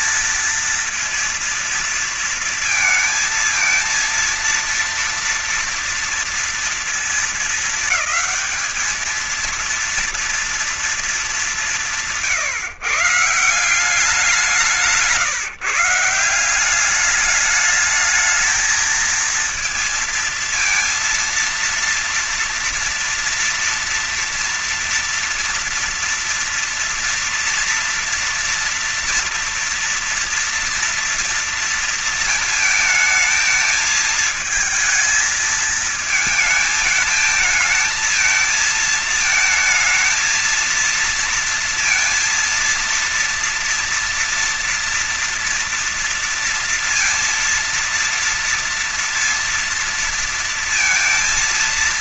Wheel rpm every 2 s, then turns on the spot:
230, 230, 230, 230, 220, 230, 160, 180, 190, 220, 230, 230, 230, 240, 230, 230, 220, 220, 220, 220, 230, 230, 230, 230, 230, 230.
none